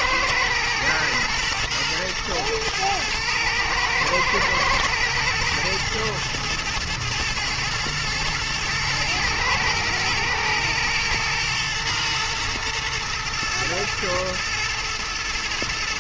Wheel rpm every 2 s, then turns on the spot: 110, 110, 120, 110, 120, 120, 120, 110.
none